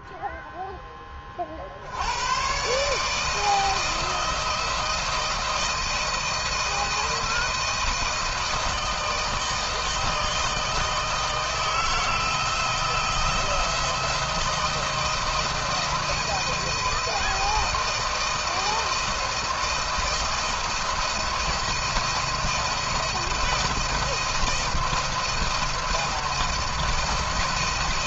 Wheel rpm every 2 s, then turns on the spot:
20, 100, 160, 160, 160, 160, 170, 160, 160, 160, 170, 170, 170, 170.
none